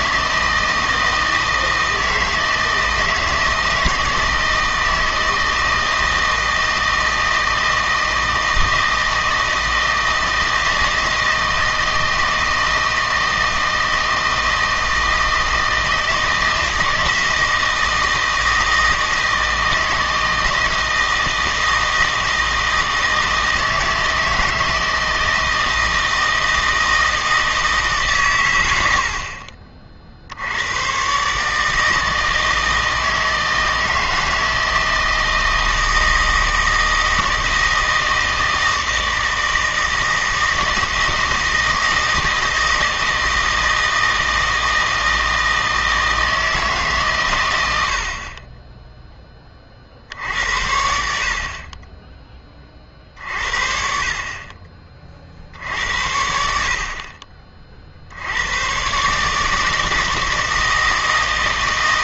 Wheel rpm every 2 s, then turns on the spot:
160, 160, 160, 160, 160, 160, 160, 160, 160, 160, 160, 160, 160, 160, 80, 110, 160, 160, 160, 160, 160, 160, 160, 150, 10, 70, 40, 30, 60, 120, 160.
none